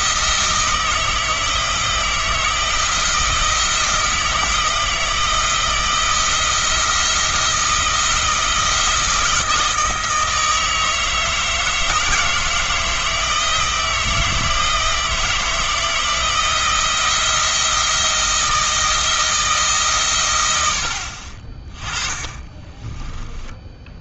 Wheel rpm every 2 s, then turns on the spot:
160, 160, 160, 170, 160, 160, 160, 160, 170, 160, 60, 20.
22-24